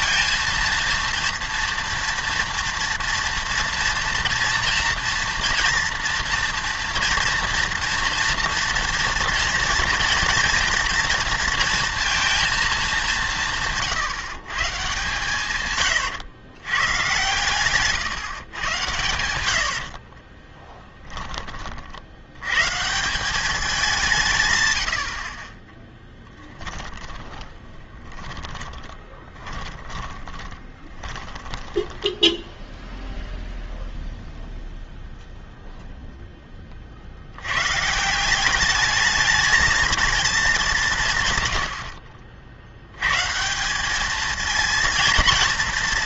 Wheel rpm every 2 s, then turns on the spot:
230, 240, 230, 230, 230, 230, 230, 140, 110, 130, 30, 110, 140, 10, 40, 20, 10, 0, 10, 190, 200, 60, 220.
20-22 26-34